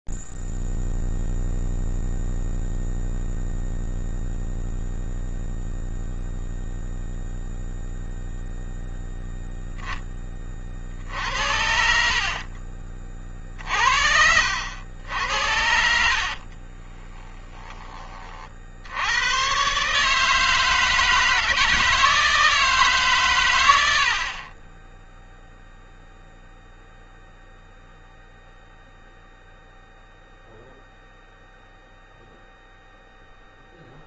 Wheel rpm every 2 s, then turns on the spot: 0, 0, 0, 0, 0, 10, 70, 50, 70, 30, 140, 160, 90, 0, 0, 0, 0.
12-14 16-18